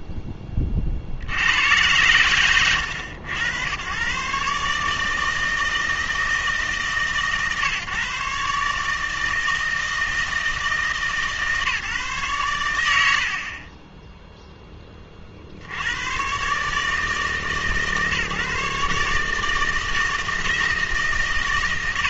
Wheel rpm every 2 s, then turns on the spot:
20, 100, 140, 150, 140, 160, 100, 10, 140, 150, 160.
none